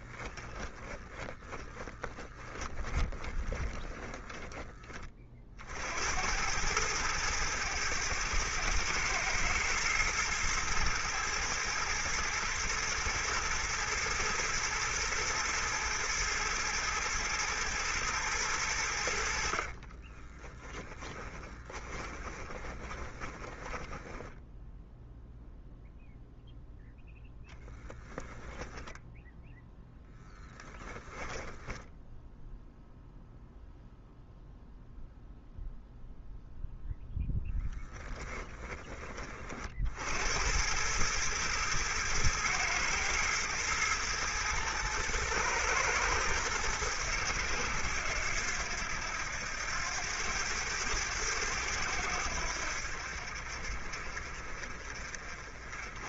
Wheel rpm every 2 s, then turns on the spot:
10, 20, 20, 100, 110, 110, 120, 110, 110, 90, 20, 20, 0, 0, 10, 10, 0, 0, 0, 20, 100, 110, 110, 100, 90, 100, 70, 40.
0-4 20-24 28-32